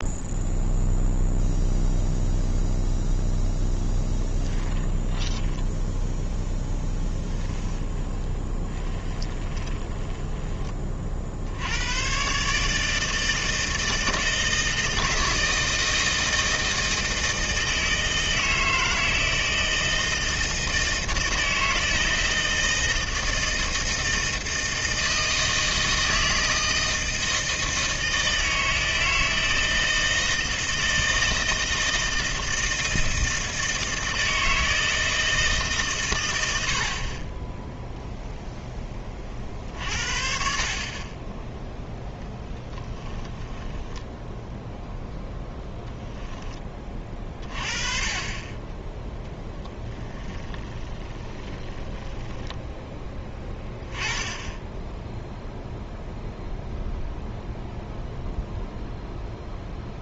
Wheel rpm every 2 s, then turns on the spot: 0, 0, 10, 0, 20, 30, 150, 160, 160, 160, 160, 160, 160, 160, 160, 160, 160, 160, 80, 10, 40, 10, 0, 20, 20, 20, 10, 10, 0, 0.
4-6 8-10 42-44 50-52